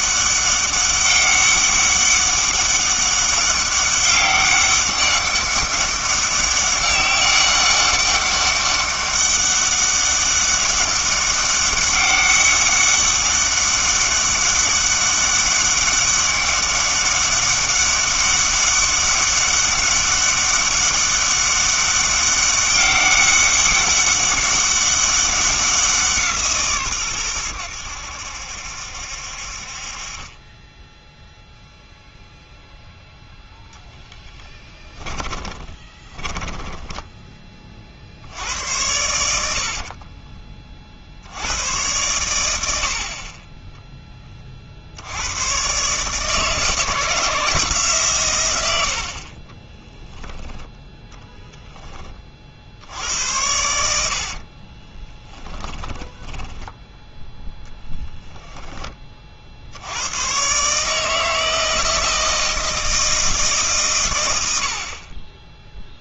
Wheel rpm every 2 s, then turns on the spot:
200, 200, 200, 200, 200, 200, 200, 200, 200, 200, 200, 200, 200, 140, 70, 10, 0, 10, 10, 90, 30, 80, 50, 160, 90, 10, 60, 30, 10, 10, 140, 160, 70.
34-38 54-58